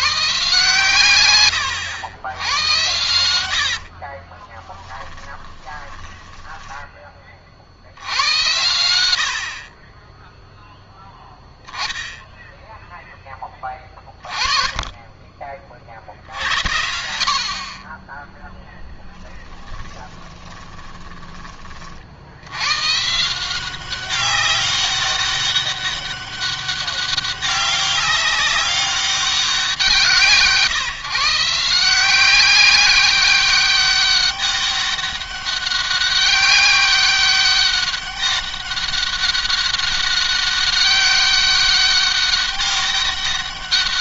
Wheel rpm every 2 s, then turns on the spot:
140, 100, 30, 20, 90, 0, 0, 30, 60, 10, 20, 110, 190, 200, 200, 170, 190, 200, 200, 200, 200, 200.
2-6 20-22